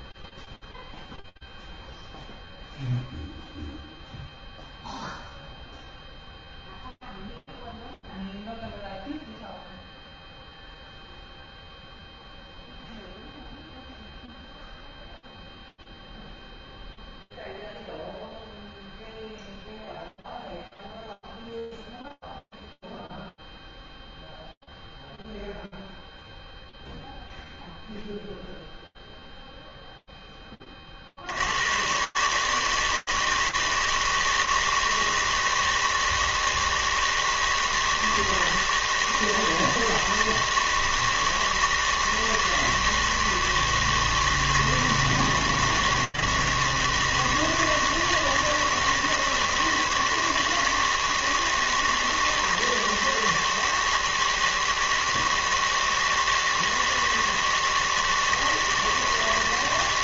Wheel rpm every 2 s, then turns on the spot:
0, 0, 0, 0, 0, 0, 0, 0, 0, 0, 0, 0, 0, 0, 0, 110, 160, 160, 160, 160, 160, 160, 160, 160, 160, 160, 160, 160, 160, 160.
none